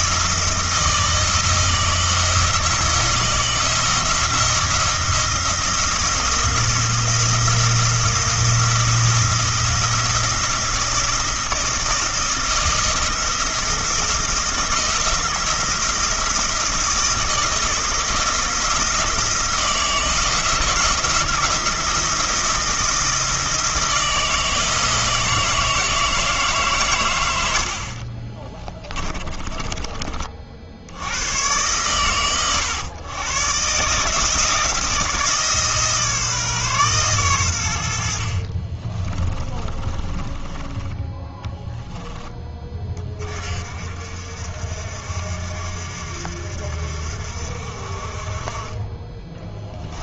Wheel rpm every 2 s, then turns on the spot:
170, 170, 170, 170, 170, 170, 160, 170, 160, 160, 170, 170, 160, 130, 20, 60, 110, 160, 140, 30, 10, 20, 60, 50, 20.
28-30 38-42 48-50